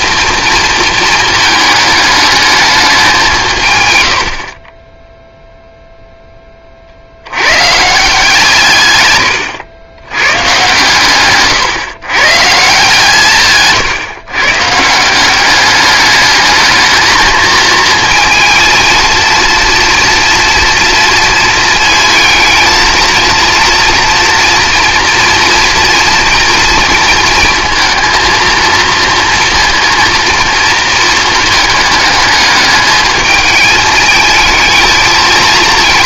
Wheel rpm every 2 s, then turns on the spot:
230, 210, 30, 40, 140, 140, 160, 160, 220, 230, 230, 220, 230, 230, 230, 230, 220, 220.
none